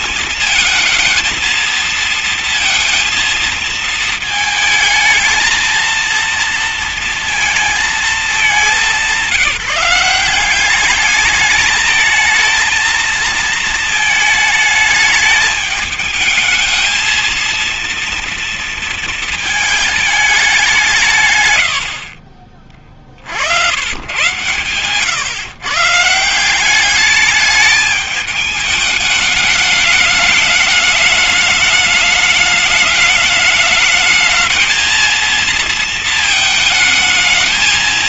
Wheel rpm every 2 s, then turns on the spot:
230, 230, 220, 230, 200, 190, 220, 220, 220, 230, 190, 40, 120, 180, 210, 210, 210, 220, 220.
none